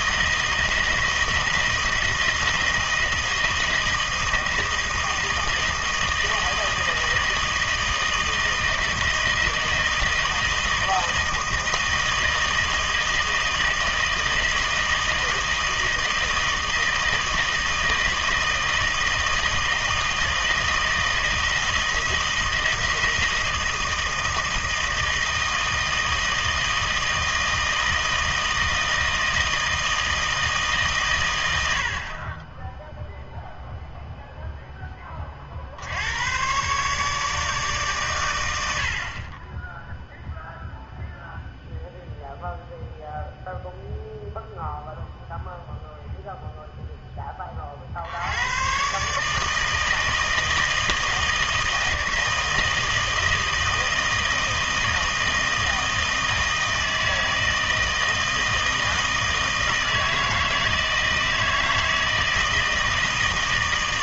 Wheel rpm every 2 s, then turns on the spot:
160, 160, 160, 160, 160, 160, 160, 160, 160, 160, 160, 160, 160, 160, 160, 140, 10, 10, 130, 70, 0, 0, 0, 0, 130, 160, 160, 160, 160, 160, 160, 160.
none